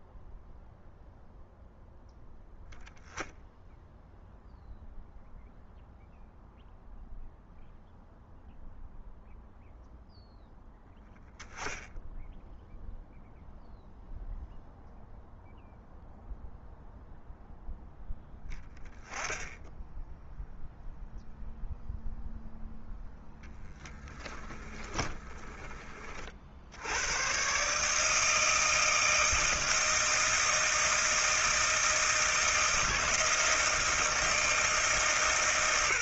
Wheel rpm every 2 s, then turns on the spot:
0, 0, 0, 0, 0, 0, 0, 0, 0, 0, 0, 0, 10, 90, 160, 160, 160, 160.
24-26